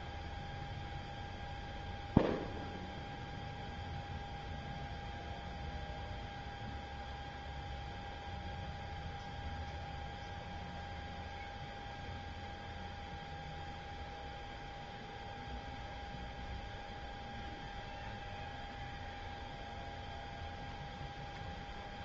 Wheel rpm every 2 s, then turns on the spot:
0, 0, 0, 0, 0, 0, 0, 0, 0, 0, 0.
none